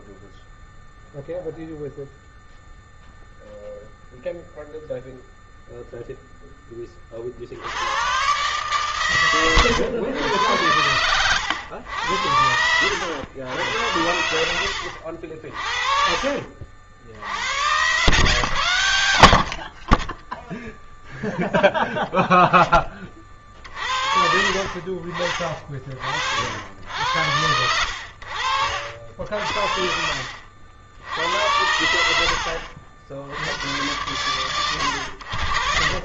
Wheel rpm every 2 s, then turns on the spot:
20, 0, 0, 10, 130, 100, 90, 80, 60, 120, 10, 10, 50, 70, 70, 70, 90, 100.
none